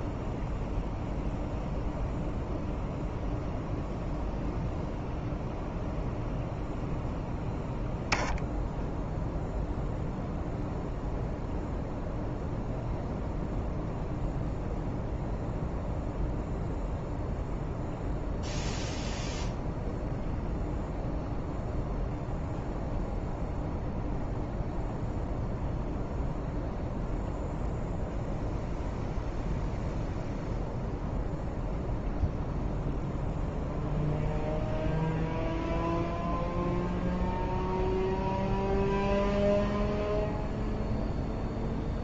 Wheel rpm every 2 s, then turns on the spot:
0, 0, 0, 0, 0, 0, 0, 0, 0, 0, 0, 0, 0, 0, 0, 0, 0, 0, 0, 0, 0.
none